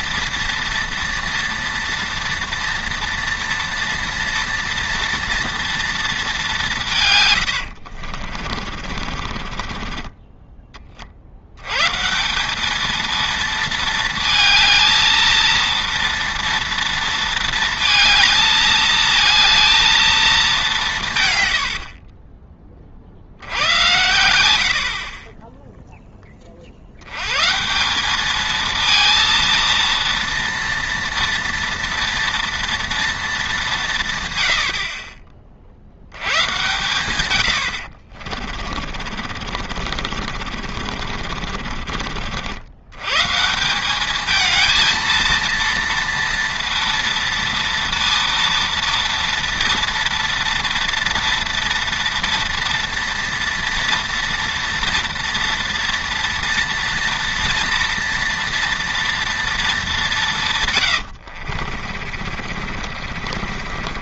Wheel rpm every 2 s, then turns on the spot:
230, 230, 230, 190, 40, 20, 210, 220, 230, 220, 190, 20, 80, 50, 220, 230, 230, 80, 120, 40, 50, 100, 220, 230, 230, 230, 230, 230, 240, 230, 130, 50.
8-10 38-42 60-64